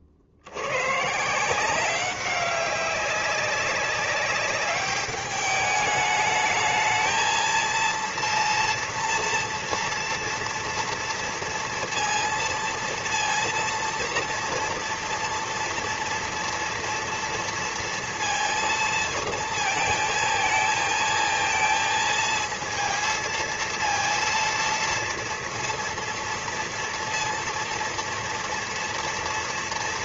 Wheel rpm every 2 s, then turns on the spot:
80, 190, 200, 220, 230, 230, 230, 230, 230, 230, 220, 230, 230, 230, 230.
none